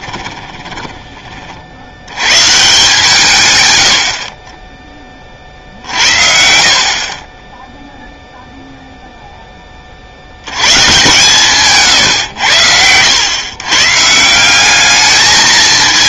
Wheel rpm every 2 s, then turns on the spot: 20, 150, 20, 50, 0, 130, 90, 200.
0-2